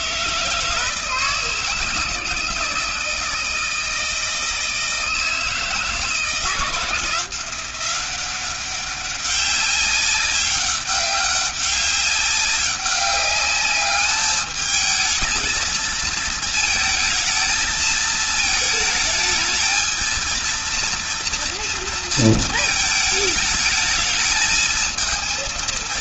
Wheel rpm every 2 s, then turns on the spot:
160, 160, 160, 160, 190, 190, 190, 220, 230, 220, 230, 220, 220.
none